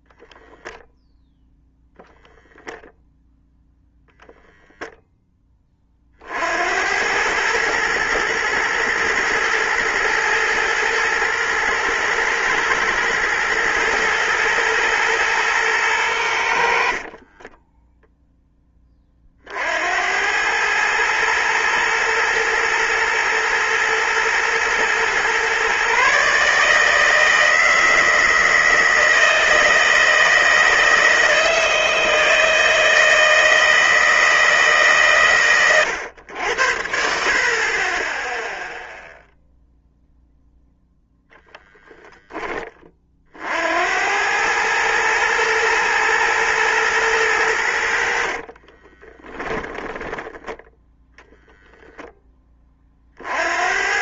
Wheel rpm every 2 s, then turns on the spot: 0, 0, 0, 70, 110, 110, 110, 120, 70, 10, 100, 110, 120, 150, 160, 160, 160, 150, 80, 0, 0, 20, 110, 120, 40, 10, 20.
48-50